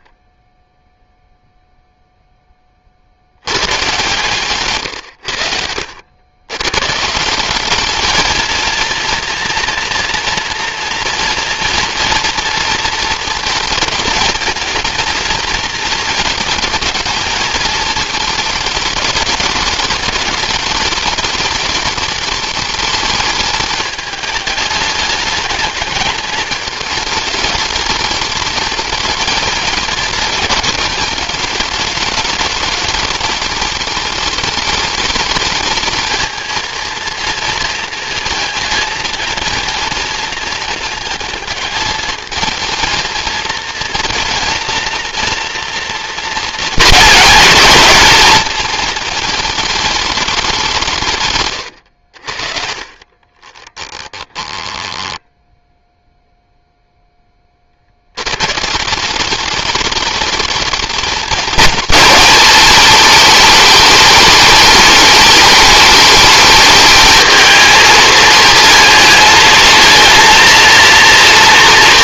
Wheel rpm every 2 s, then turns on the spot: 0, 30, 130, 120, 230, 230, 220, 220, 220, 220, 210, 210, 210, 220, 210, 220, 220, 210, 220, 230, 220, 220, 230, 230, 230, 170, 40, 10, 0, 160, 220, 220, 210, 210, 220, 230.
4-6 54-56